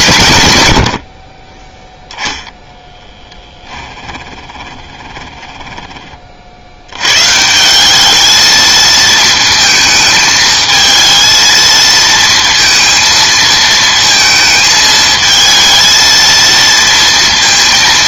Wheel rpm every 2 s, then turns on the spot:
90, 0, 20, 60, 220, 220, 230, 220, 230.
4-6